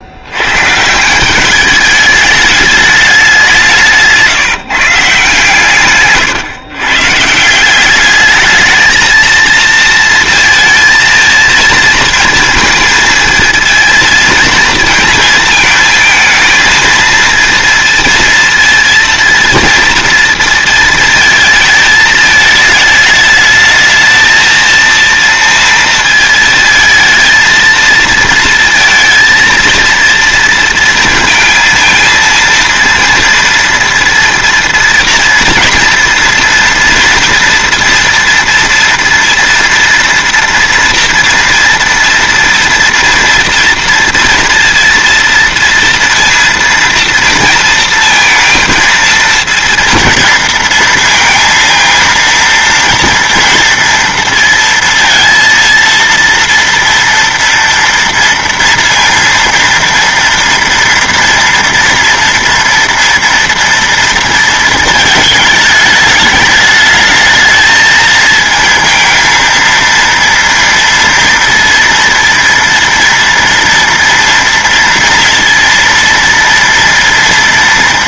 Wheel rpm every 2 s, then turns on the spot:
130, 210, 150, 140, 220, 230, 230, 230, 230, 230, 230, 210, 230, 220, 230, 230, 230, 230, 230, 230, 230, 230, 230, 230, 230, 230, 230, 230, 230, 230, 230, 230, 220, 210, 220, 230, 230, 230, 230.
none